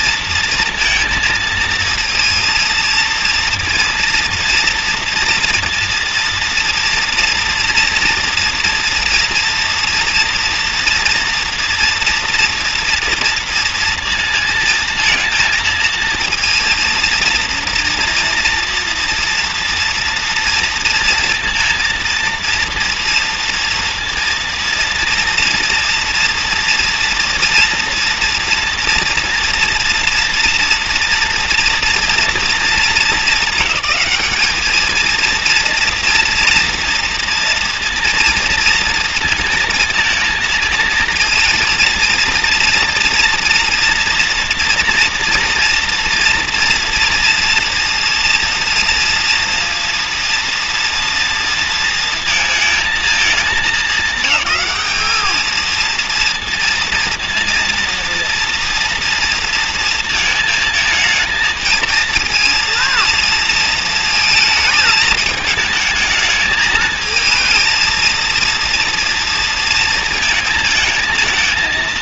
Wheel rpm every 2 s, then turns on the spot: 230, 230, 230, 230, 230, 240, 230, 230, 230, 230, 230, 230, 230, 230, 230, 230, 220, 210, 230, 230, 230, 240, 230, 230, 240, 230, 230, 200, 230, 230, 220, 230, 220, 220, 230, 220.
none